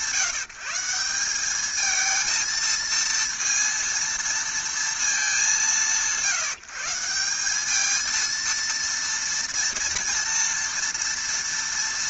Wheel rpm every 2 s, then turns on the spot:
170, 230, 230, 170, 230, 230.
none